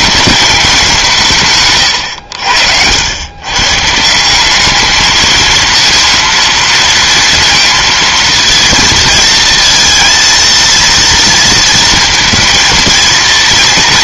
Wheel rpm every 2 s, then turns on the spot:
200, 80, 200, 230, 230, 230, 230.
none